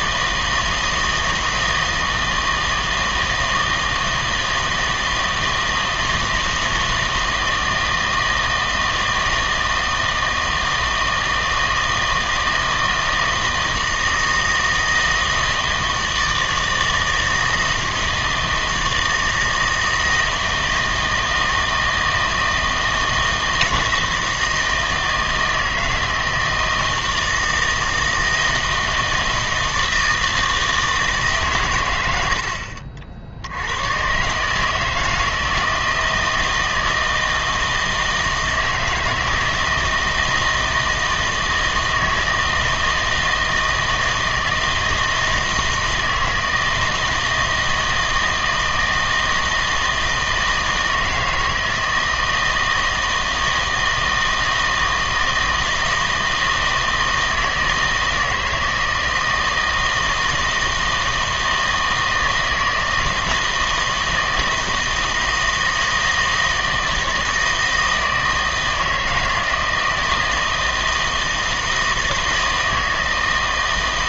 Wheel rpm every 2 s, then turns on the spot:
160, 160, 160, 160, 160, 160, 160, 160, 160, 160, 160, 160, 160, 160, 160, 160, 60, 160, 160, 160, 160, 160, 160, 160, 160, 160, 160, 160, 160, 160, 160, 160, 160, 160, 160, 160, 160.
none